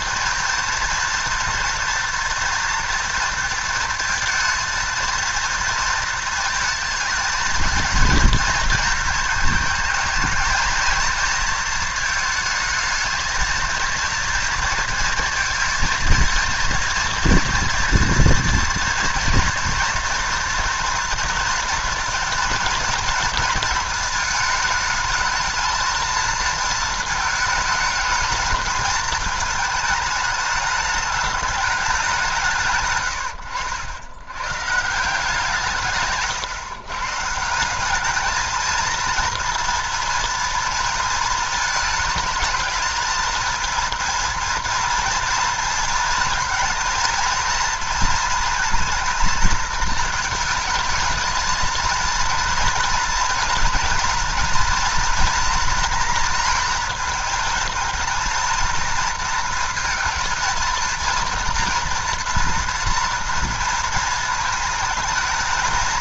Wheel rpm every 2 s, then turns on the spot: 230, 230, 230, 220, 220, 230, 220, 230, 230, 230, 230, 230, 220, 220, 220, 220, 130, 150, 130, 220, 220, 220, 230, 220, 230, 220, 230, 230, 230, 230, 230, 230, 220.
none